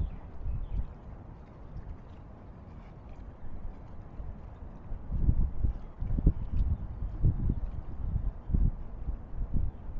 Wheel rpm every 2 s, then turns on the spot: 0, 0, 0, 0, 0.
none